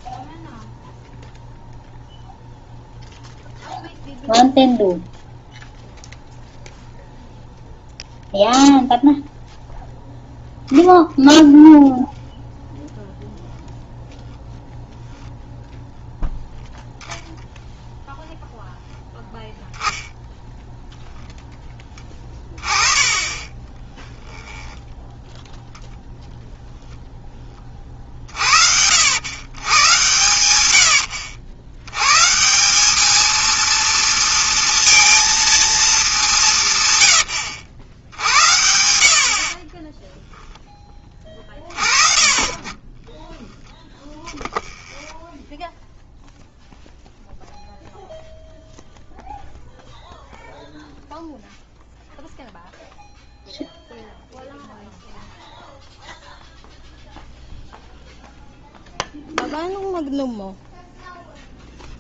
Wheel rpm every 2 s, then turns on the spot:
0, 0, 0, 0, 0, 0, 10, 0, 0, 0, 0, 20, 10, 0, 60, 100, 170, 230, 150, 90, 10, 20, 10, 0, 0, 0, 0, 0, 0, 0, 0.
12-14 38-40 44-46